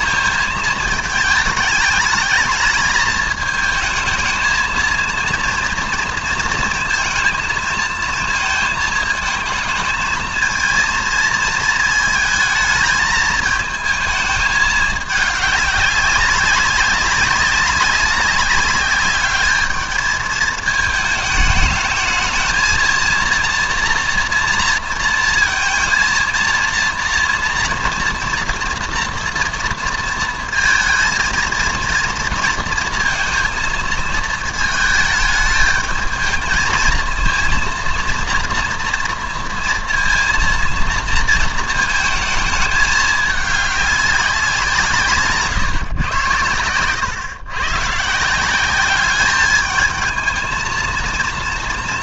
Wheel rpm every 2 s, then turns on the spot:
220, 210, 220, 230, 220, 220, 220, 210, 190, 200, 220, 230, 230, 230, 240, 230, 230, 220, 220, 230, 230, 210, 170, 110, 190, 230.
none